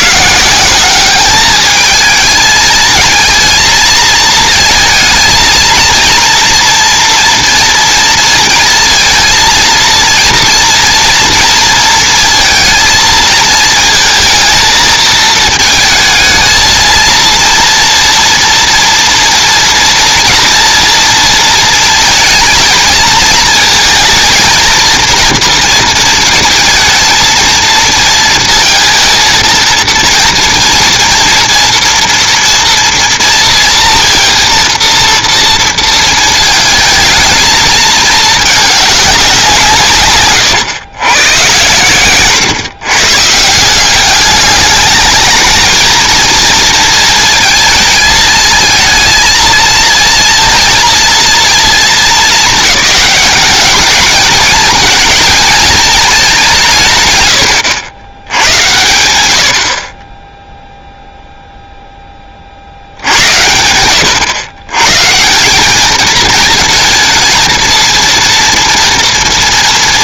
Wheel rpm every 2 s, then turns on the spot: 180, 220, 220, 230, 230, 230, 230, 220, 220, 230, 230, 230, 230, 220, 230, 230, 230, 230, 220, 210, 120, 120, 210, 230, 220, 230, 210, 220, 160, 110, 0, 60, 140, 220, 230.
none